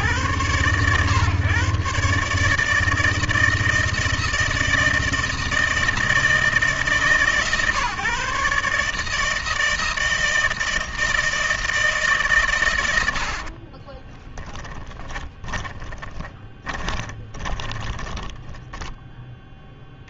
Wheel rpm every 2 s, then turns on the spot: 130, 160, 160, 140, 160, 160, 40, 20, 20, 10.
12-18